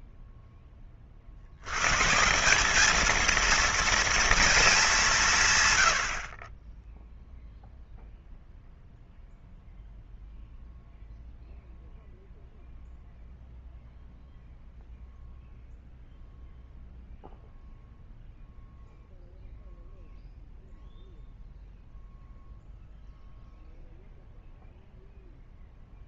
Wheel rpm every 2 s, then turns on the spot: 10, 190, 220, 20, 0, 0, 0, 0, 0, 0, 0, 0, 0.
none